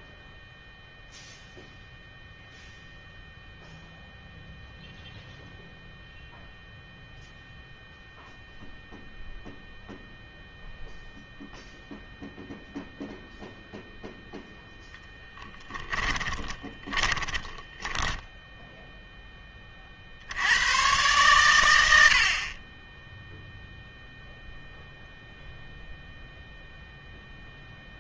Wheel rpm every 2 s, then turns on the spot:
0, 0, 0, 0, 0, 0, 0, 10, 20, 0, 100, 20, 0, 0.
16-18